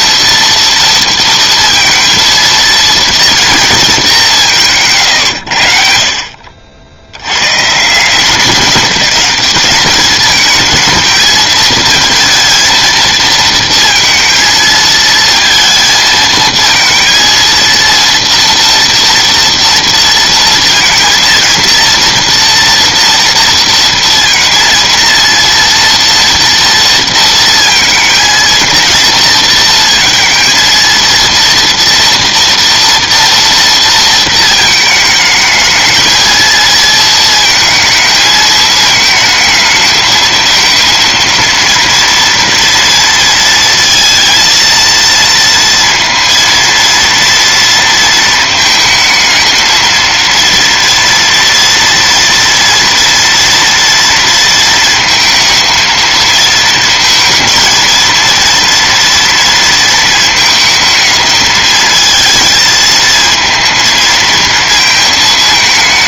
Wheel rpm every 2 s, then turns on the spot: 230, 230, 140, 60, 200, 220, 230, 220, 230, 230, 230, 230, 230, 230, 230, 230, 230, 220, 230, 220, 230, 230, 230, 230, 220, 230, 230, 230, 230, 230, 220, 220, 230.
none